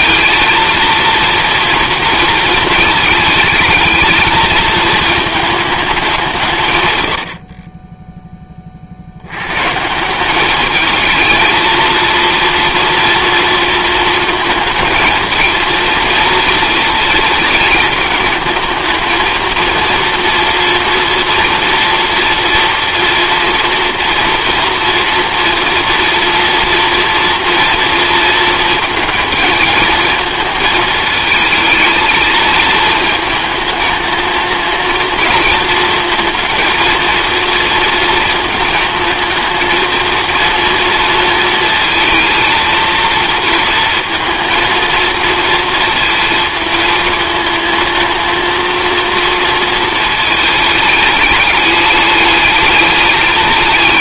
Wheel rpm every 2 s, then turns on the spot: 230, 220, 220, 120, 40, 210, 230, 230, 230, 220, 240, 230, 230, 240, 230, 220, 220, 230, 230, 220, 230, 230, 230, 230, 230, 210, 210.
none